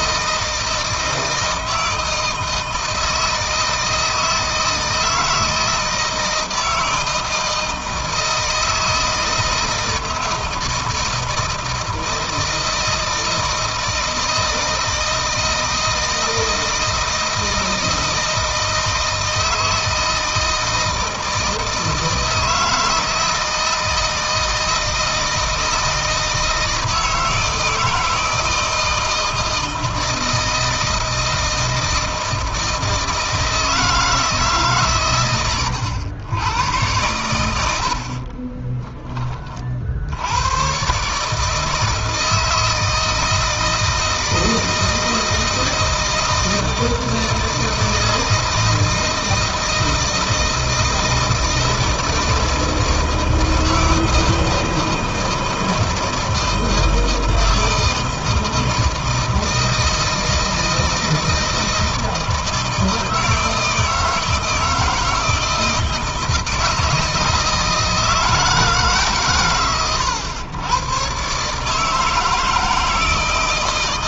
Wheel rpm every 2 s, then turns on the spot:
160, 160, 160, 160, 160, 160, 160, 160, 160, 160, 160, 160, 160, 160, 160, 160, 160, 130, 100, 20, 120, 160, 160, 160, 160, 160, 160, 160, 160, 160, 160, 160, 160, 160, 150, 110, 160.
38-40